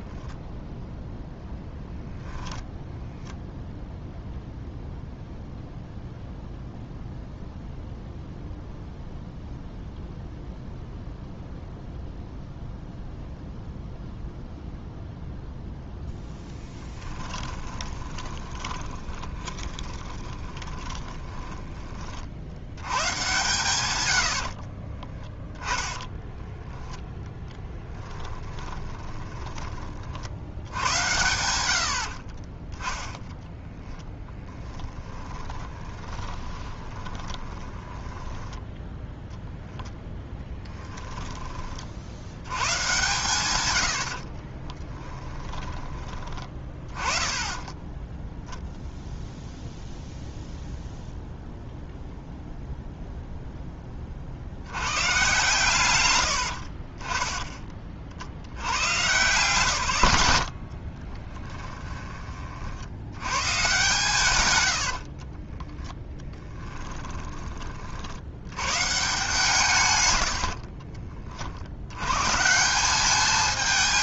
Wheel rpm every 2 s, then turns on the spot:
10, 0, 0, 0, 0, 0, 0, 0, 10, 20, 30, 80, 30, 10, 20, 90, 10, 20, 30, 10, 10, 110, 20, 20, 0, 0, 0, 100, 40, 100, 40, 70, 70, 20, 130, 40, 180.
16-22 24-26 28-30 34-38 40-42 44-46 60-62 64-68 70-72